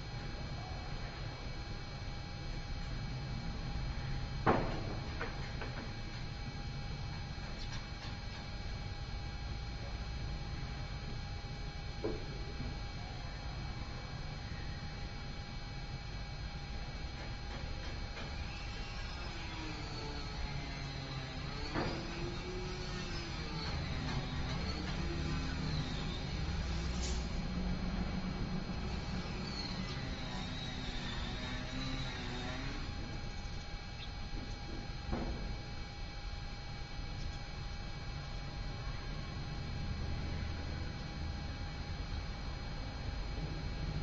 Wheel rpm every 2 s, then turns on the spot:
0, 0, 0, 0, 0, 0, 0, 0, 0, 0, 0, 0, 0, 0, 0, 0, 0, 0, 0, 0, 0, 0.
none